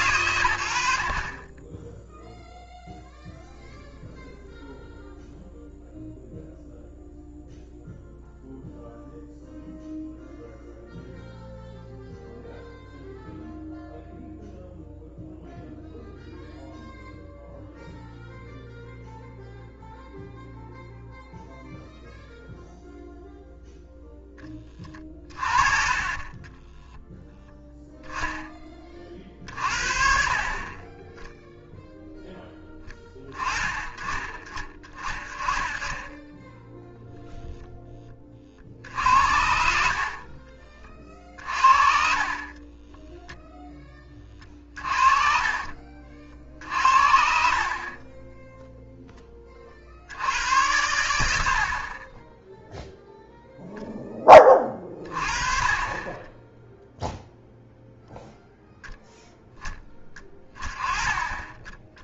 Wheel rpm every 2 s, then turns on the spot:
60, 0, 0, 0, 0, 0, 0, 0, 0, 0, 0, 0, 30, 10, 20, 20, 10, 30, 0, 60, 30, 20, 30, 60, 0, 90, 0, 30, 0, 0, 20.
24-28 40-46